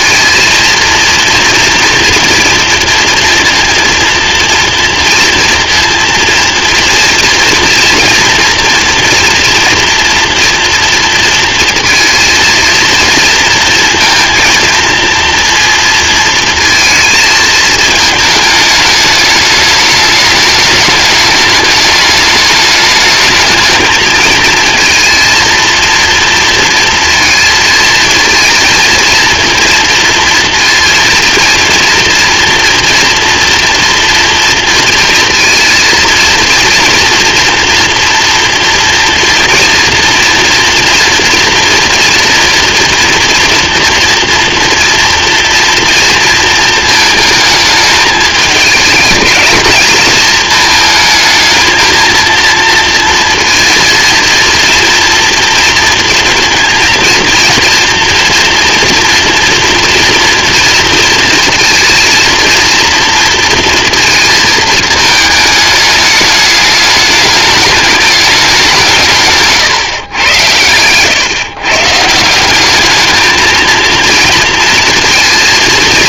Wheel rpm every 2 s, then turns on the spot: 230, 230, 230, 230, 230, 230, 230, 230, 230, 210, 210, 220, 230, 230, 230, 230, 230, 230, 230, 230, 230, 230, 240, 220, 210, 220, 230, 230, 230, 240, 230, 230, 220, 210, 180, 110, 200, 230.
70-72